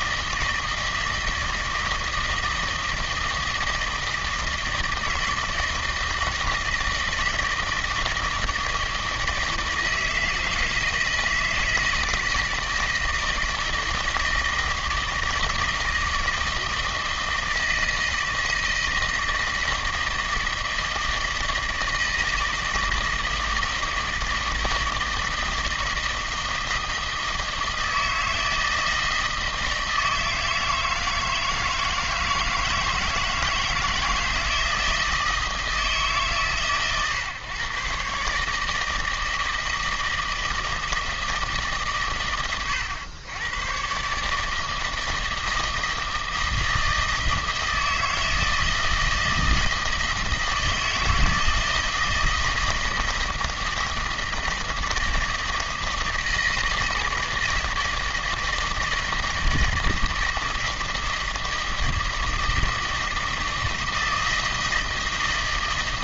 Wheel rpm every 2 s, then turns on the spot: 160, 160, 160, 160, 160, 160, 160, 160, 160, 160, 160, 160, 160, 160, 160, 160, 160, 160, 140, 150, 160, 110, 160, 160, 160, 160, 160, 160, 160, 160, 160, 160, 160.
none